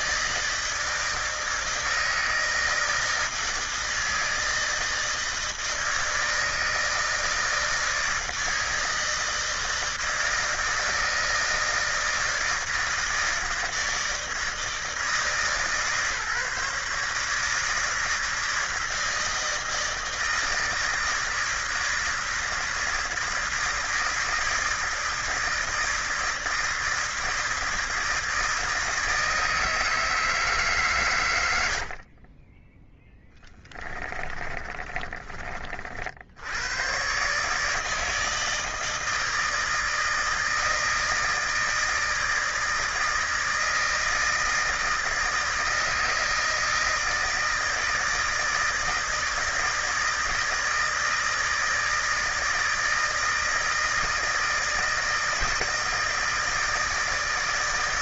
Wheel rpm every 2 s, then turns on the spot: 160, 160, 160, 160, 160, 160, 160, 160, 150, 160, 160, 160, 160, 160, 160, 150, 20, 30, 90, 160, 160, 160, 160, 160, 160, 160, 160, 160, 160.
32-36